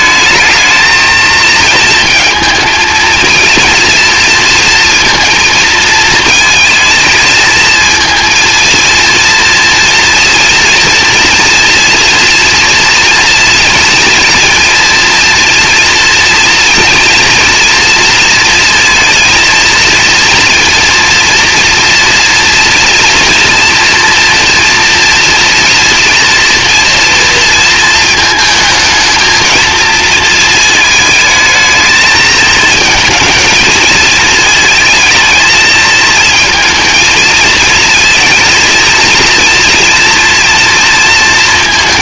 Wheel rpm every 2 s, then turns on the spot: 220, 230, 240, 230, 230, 230, 230, 230, 240, 230, 230, 240, 230, 230, 230, 220, 220, 230, 220, 230, 230.
none